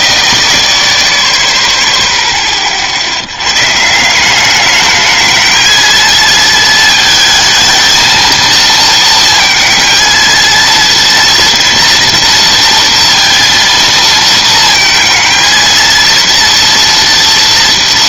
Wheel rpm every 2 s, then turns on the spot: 0, 50, 210, 220, 230, 230, 230, 220, 230.
none